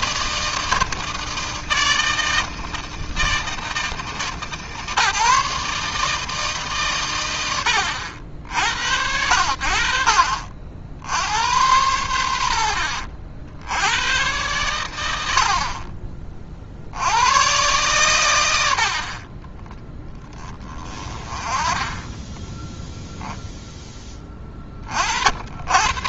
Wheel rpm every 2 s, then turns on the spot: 160, 160, 150, 140, 70, 50, 70, 110, 50, 80, 20, 10, 30.
12-14